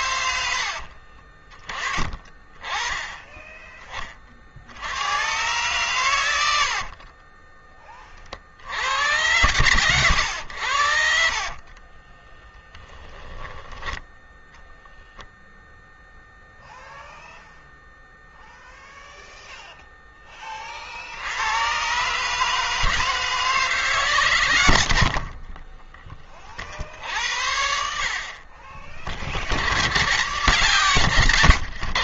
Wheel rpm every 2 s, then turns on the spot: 60, 20, 80, 50, 80, 60, 10, 10, 0, 0, 60, 160, 70, 60, 40, 140.
0-2 6-8 24-26 30-32